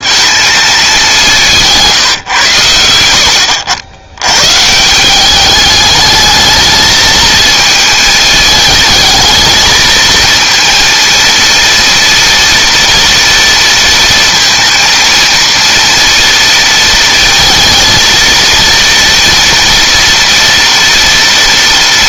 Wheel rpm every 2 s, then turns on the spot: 200, 90, 160, 220, 220, 230, 240, 230, 230, 230, 230.
none